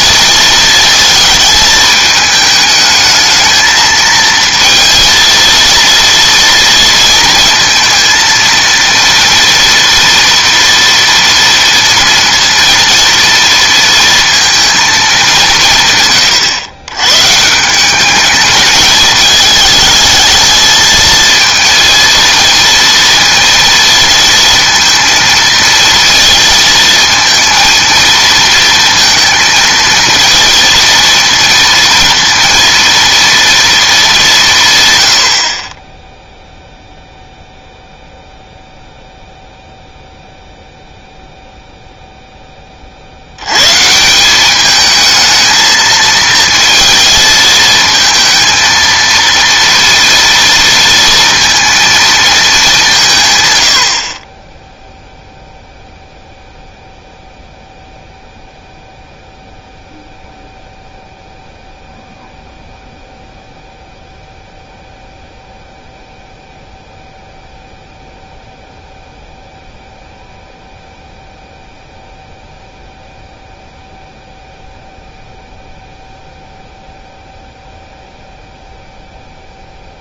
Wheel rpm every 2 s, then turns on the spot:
230, 220, 230, 230, 230, 230, 230, 220, 110, 210, 220, 230, 230, 230, 230, 230, 230, 140, 0, 0, 0, 30, 210, 220, 230, 230, 200, 10, 0, 0, 0, 0, 0, 0, 0, 0, 0, 0, 0, 0.
none